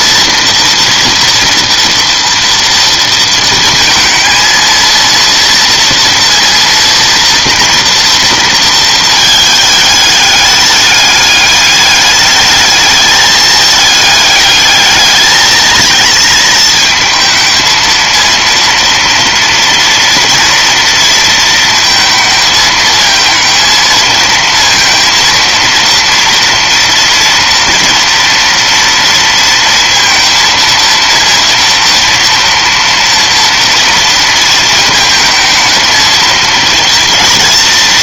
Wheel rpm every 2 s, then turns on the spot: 230, 230, 230, 230, 210, 200, 210, 220, 220, 230, 230, 220, 230, 230, 230, 230, 230, 220, 230.
none